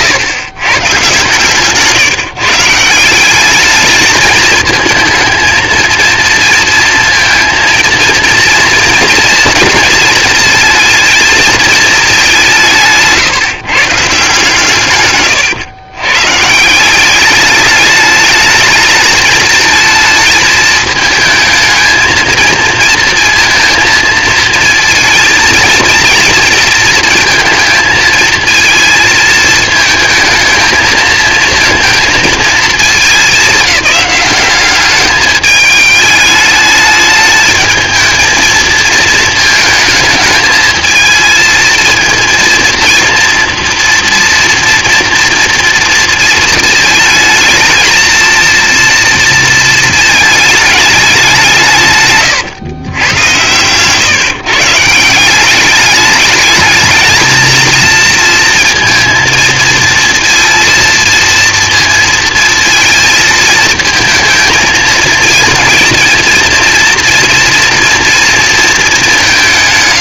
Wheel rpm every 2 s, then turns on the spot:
120, 150, 220, 230, 230, 220, 180, 140, 160, 220, 220, 220, 230, 230, 220, 220, 220, 190, 210, 220, 220, 230, 240, 220, 230, 210, 130, 150, 210, 230, 230, 230, 220, 230, 230.
none